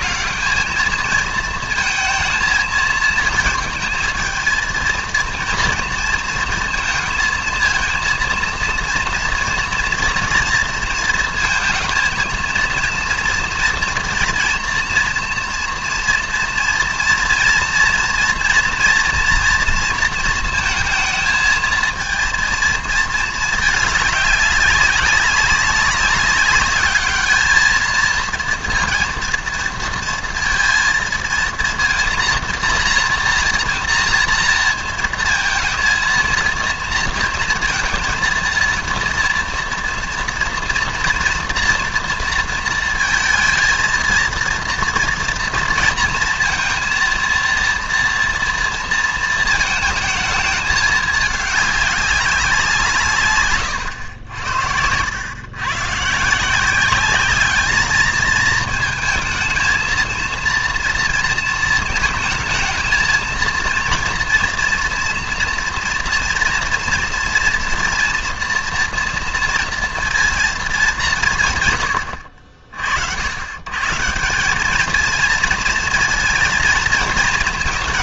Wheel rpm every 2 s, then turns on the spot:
220, 220, 230, 230, 230, 230, 230, 230, 230, 230, 220, 230, 200, 200, 230, 230, 230, 230, 230, 230, 230, 230, 230, 230, 230, 220, 190, 80, 180, 220, 230, 220, 230, 230, 240, 220, 60, 200, 230.
none